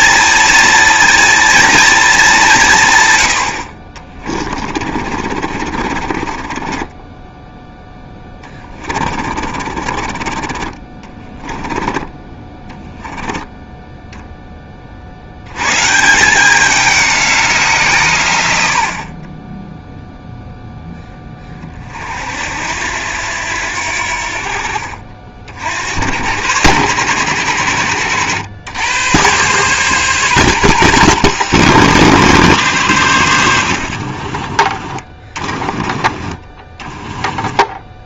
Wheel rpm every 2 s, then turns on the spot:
230, 160, 40, 20, 20, 30, 10, 30, 190, 80, 0, 70, 50, 110, 100, 130, 120, 40, 20.
4-10 34-38